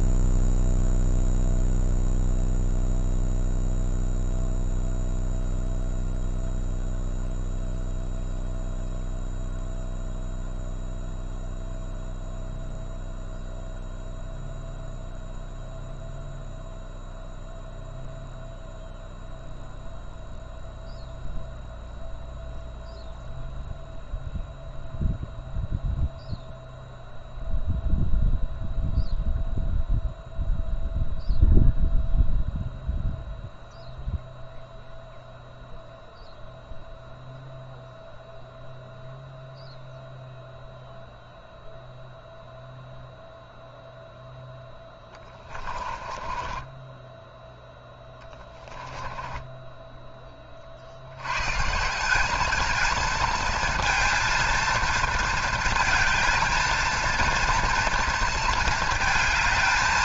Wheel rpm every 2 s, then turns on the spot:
0, 0, 0, 0, 0, 0, 0, 0, 0, 0, 0, 0, 0, 0, 0, 0, 0, 0, 0, 0, 0, 0, 0, 20, 30, 50, 220, 230, 230, 230.
46-50